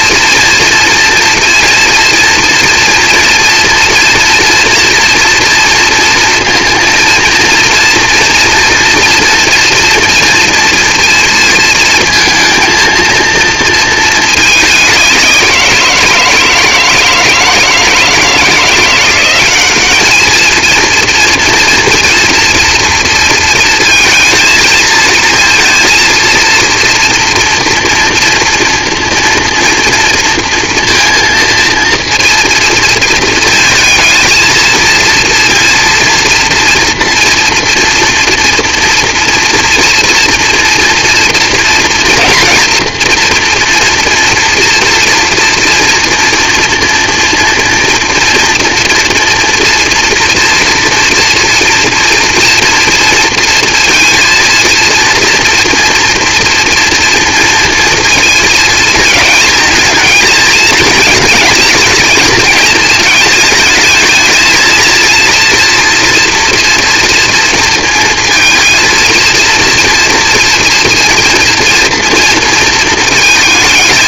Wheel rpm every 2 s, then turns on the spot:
230, 230, 230, 230, 230, 230, 220, 190, 160, 180, 230, 230, 220, 230, 230, 230, 230, 230, 230, 240, 230, 230, 230, 230, 230, 240, 230, 230, 230, 220, 220, 220, 230, 230, 230, 230, 220.
none